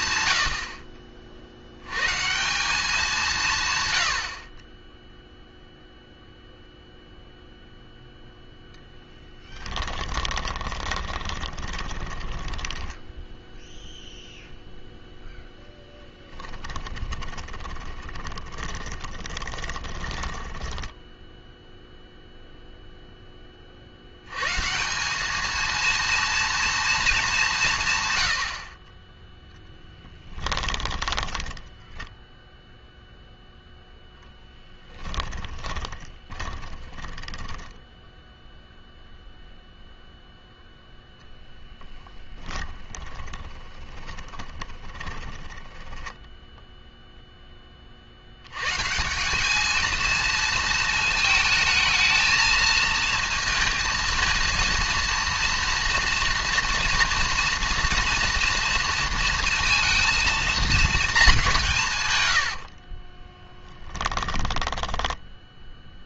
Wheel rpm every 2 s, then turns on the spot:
80, 180, 40, 0, 0, 20, 10, 0, 20, 20, 10, 0, 140, 230, 50, 10, 0, 10, 20, 0, 0, 20, 20, 0, 120, 230, 230, 230, 240, 230, 230, 80, 10.
10-14 16-22 30-32 34-38 42-46 62-66